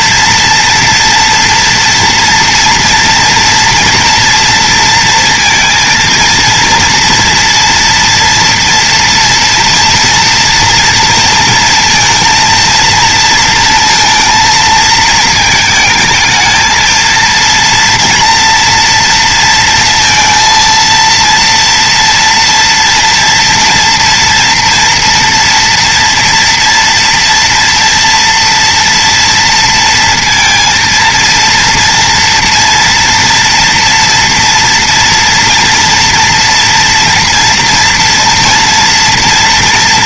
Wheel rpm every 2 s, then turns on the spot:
230, 230, 230, 230, 230, 230, 230, 220, 220, 230, 230, 230, 230, 230, 240, 230, 230, 230, 230, 230.
none